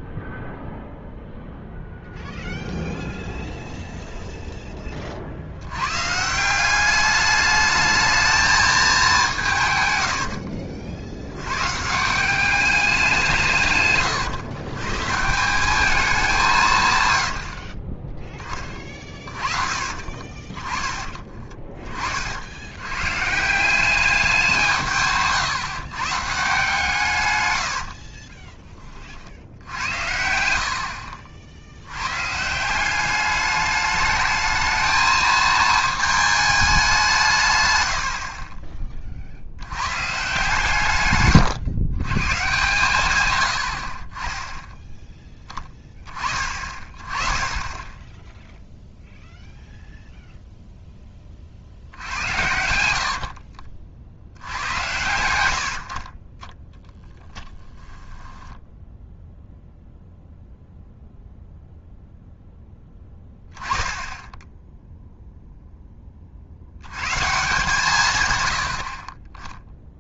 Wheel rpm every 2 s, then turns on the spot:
0, 0, 10, 180, 220, 60, 200, 120, 160, 20, 40, 80, 180, 150, 30, 60, 170, 220, 210, 30, 140, 130, 10, 30, 0, 0, 80, 90, 10, 0, 0, 0, 0, 80, 90.
10-12 18-20 38-40 52-54